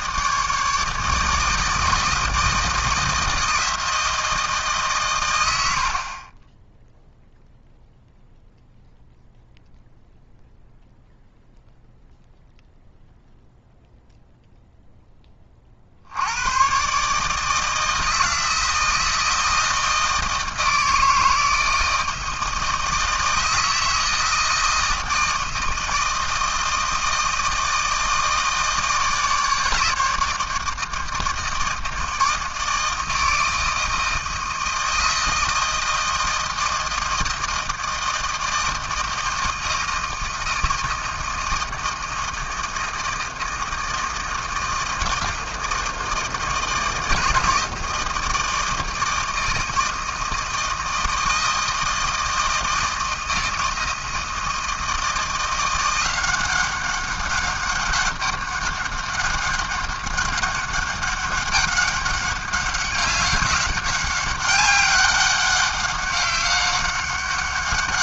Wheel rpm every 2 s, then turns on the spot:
160, 160, 150, 10, 0, 0, 0, 0, 120, 160, 160, 160, 160, 160, 160, 160, 160, 160, 160, 160, 160, 160, 160, 160, 160, 160, 160, 160, 190, 200, 200, 200, 200, 200.
none